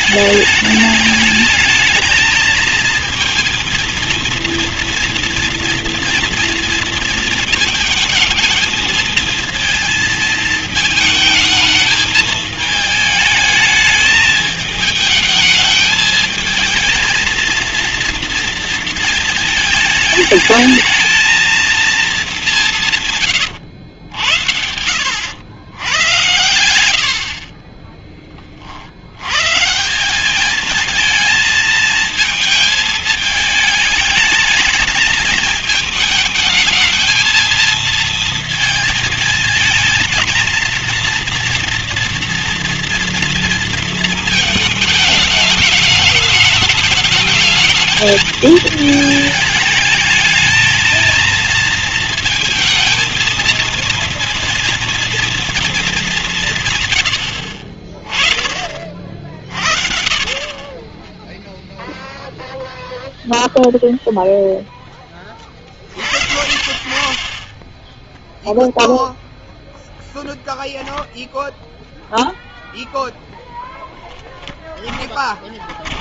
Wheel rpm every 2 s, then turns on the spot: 220, 230, 230, 220, 230, 220, 210, 220, 220, 220, 220, 100, 100, 50, 100, 220, 220, 220, 220, 230, 240, 230, 220, 220, 220, 230, 230, 230, 90, 40, 10, 0, 0, 50, 0, 10, 0, 10.
22-24 26-28